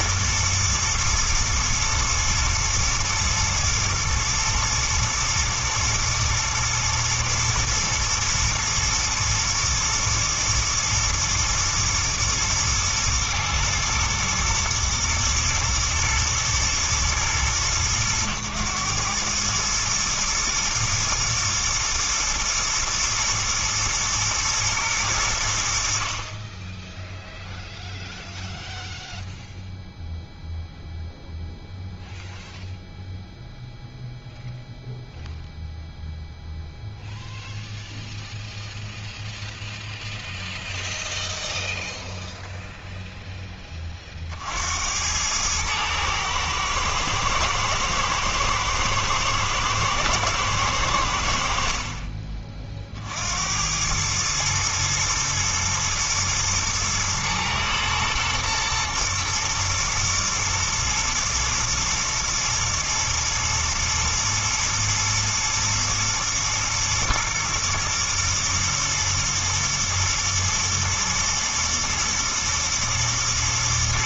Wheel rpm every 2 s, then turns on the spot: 110, 120, 110, 120, 110, 110, 110, 110, 110, 110, 120, 120, 110, 10, 0, 0, 0, 0, 0, 0, 0, 0, 80, 110, 110, 90, 50, 110, 120, 120, 110, 120, 120, 120, 120, 110, 120.
none